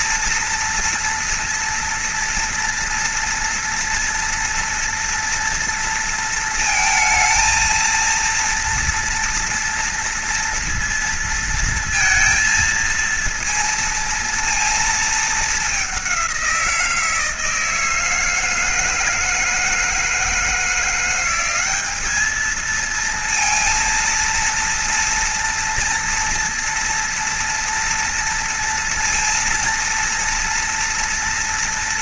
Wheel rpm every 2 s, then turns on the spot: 230, 230, 240, 220, 230, 230, 230, 220, 170, 160, 170, 230, 230, 230, 230, 230.
none